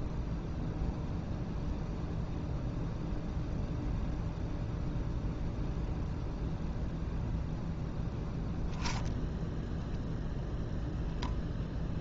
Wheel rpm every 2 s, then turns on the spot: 0, 0, 0, 0, 0, 0.
none